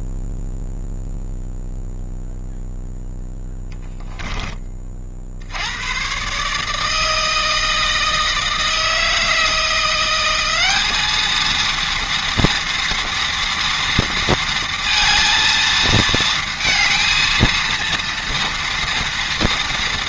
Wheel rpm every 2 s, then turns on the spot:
0, 0, 30, 150, 160, 200, 230, 230, 220, 230.
none